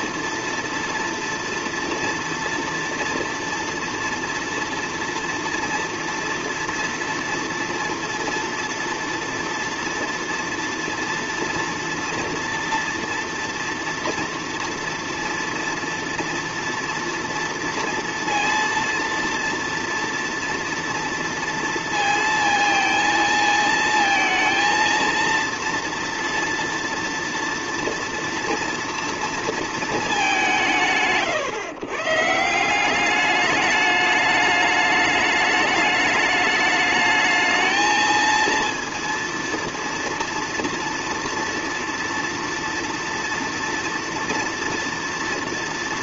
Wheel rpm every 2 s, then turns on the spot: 230, 230, 230, 230, 230, 230, 230, 230, 230, 230, 230, 230, 230, 230, 230, 150, 170, 210, 210, 230, 230, 230, 230.
none